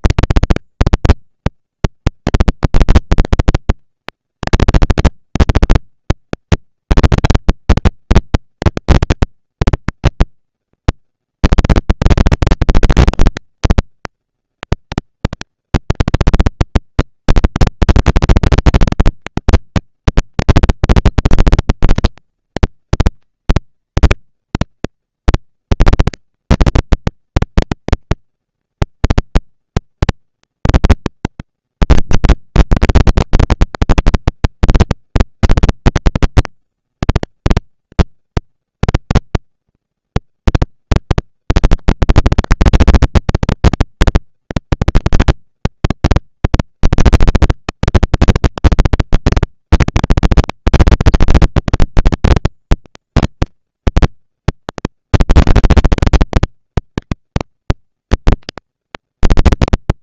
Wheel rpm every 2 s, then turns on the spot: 200, 200, 230, 230, 230, 230, 230, 230, 230, 230, 230, 220, 230, 230, 230, 230, 210, 190, 200, 230, 230, 230, 230, 230, 230, 230, 230, 230, 230, 230.
none